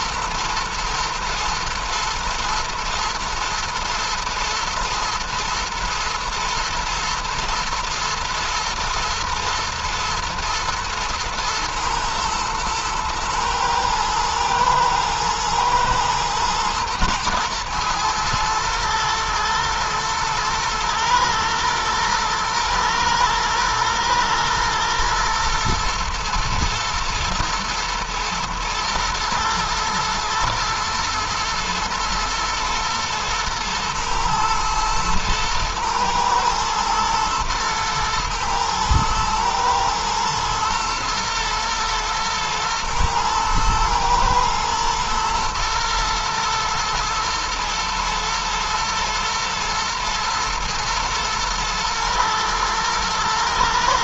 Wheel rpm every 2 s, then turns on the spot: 110, 110, 120, 110, 110, 110, 110, 120, 110, 110, 120, 120, 120, 120, 120, 120, 120, 110, 110, 110, 110, 110, 110, 110, 120, 110, 110.
none